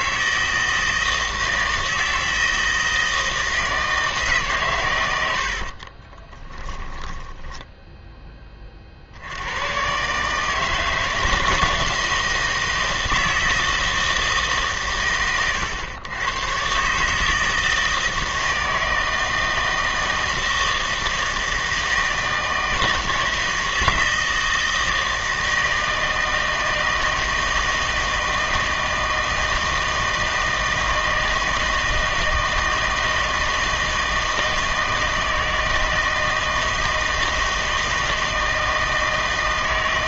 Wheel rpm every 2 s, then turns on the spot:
160, 160, 130, 10, 40, 160, 160, 140, 130, 160, 160, 160, 160, 160, 160, 160, 160, 160, 160, 160.
6-8